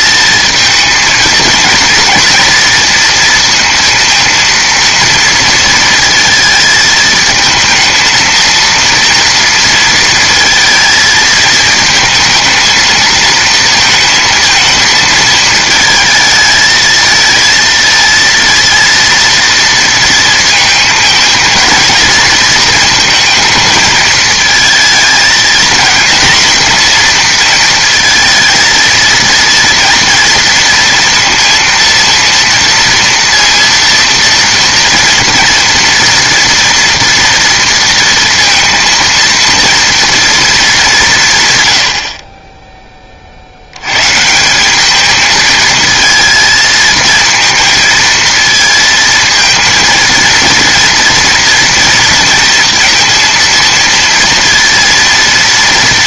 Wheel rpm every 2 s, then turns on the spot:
220, 230, 230, 220, 230, 220, 220, 220, 230, 230, 220, 230, 220, 230, 230, 230, 230, 230, 230, 230, 190, 20, 210, 230, 220, 240, 240, 230.
none